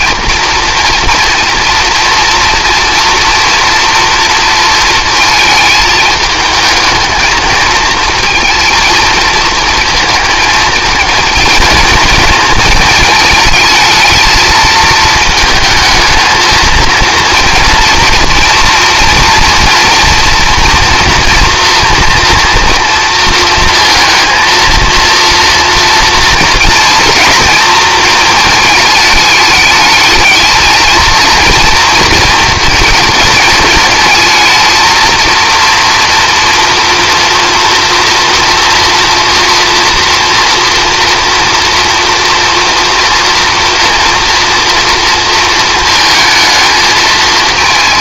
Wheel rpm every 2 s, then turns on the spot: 230, 240, 230, 220, 230, 220, 220, 220, 230, 230, 230, 230, 230, 230, 220, 220, 230, 230, 230, 230, 230, 230, 230, 220.
none